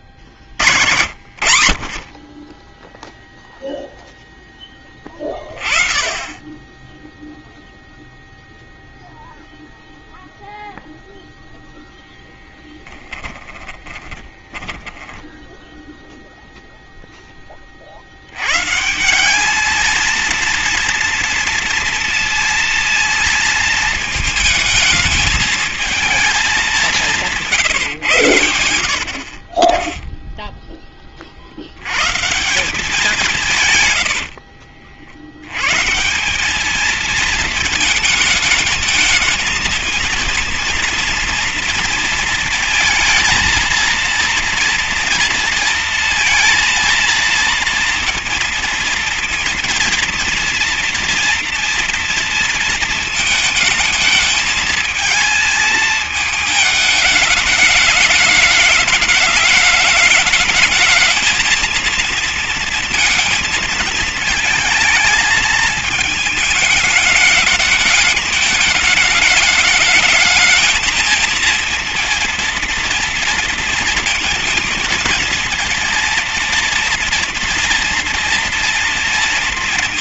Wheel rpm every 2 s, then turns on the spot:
70, 0, 10, 10, 0, 0, 10, 10, 0, 140, 230, 230, 220, 200, 60, 10, 180, 60, 210, 220, 230, 230, 230, 230, 230, 230, 220, 220, 220, 210, 220, 230, 220, 220, 210, 230, 230, 230, 230, 230.
12-16